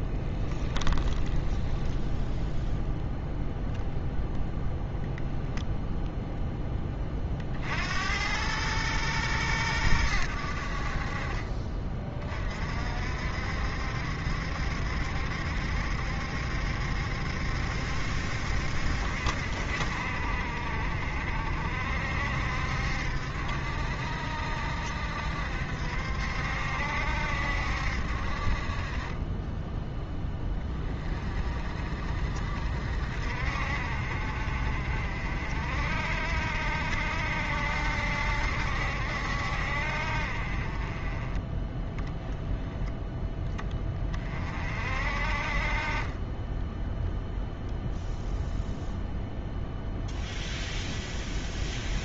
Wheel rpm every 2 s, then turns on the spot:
10, 0, 0, 10, 110, 60, 60, 70, 70, 60, 50, 60, 70, 70, 30, 20, 50, 50, 60, 70, 30, 10, 40, 10, 0, 0.
0-2